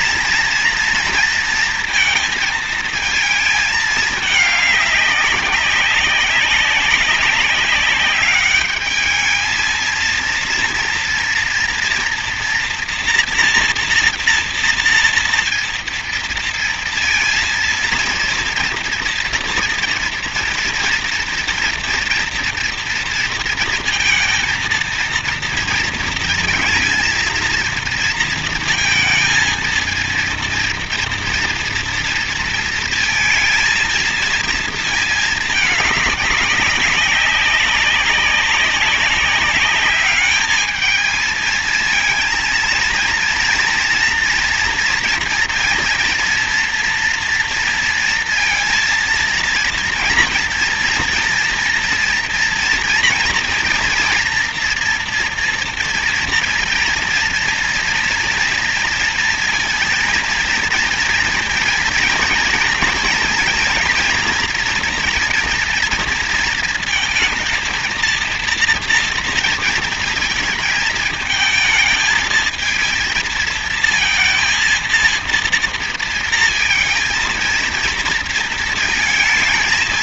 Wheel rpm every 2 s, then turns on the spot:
230, 230, 200, 200, 210, 230, 230, 230, 230, 230, 230, 230, 230, 230, 230, 230, 230, 230, 200, 190, 210, 230, 230, 230, 230, 230, 230, 240, 230, 230, 230, 230, 230, 230, 230, 220, 230, 230, 220, 230.
none